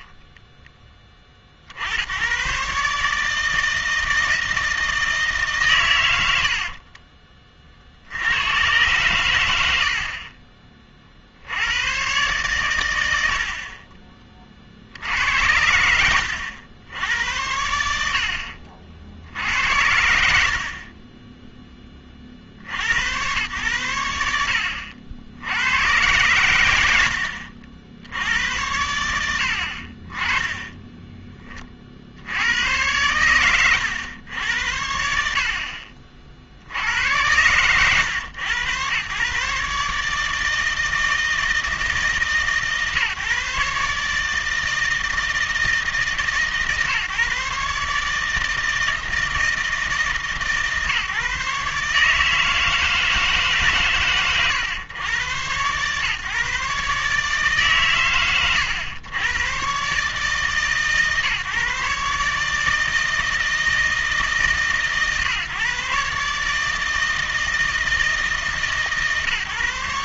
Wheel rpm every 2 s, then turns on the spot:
20, 140, 160, 80, 110, 30, 110, 60, 80, 50, 50, 70, 70, 90, 100, 20, 90, 80, 70, 110, 160, 140, 160, 150, 160, 140, 160, 120, 140, 110, 140, 150, 140, 150, 150.
20-22